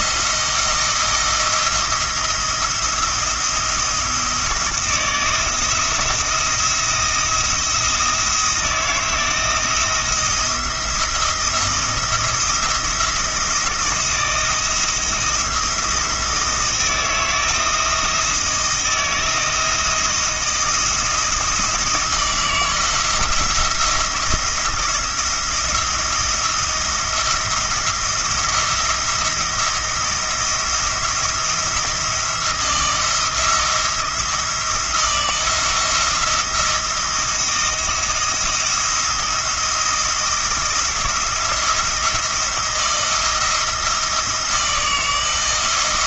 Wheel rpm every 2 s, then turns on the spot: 160, 170, 160, 170, 160, 170, 170, 170, 160, 170, 170, 170, 170, 170, 170, 170, 170, 170, 170, 170, 170, 170, 160.
none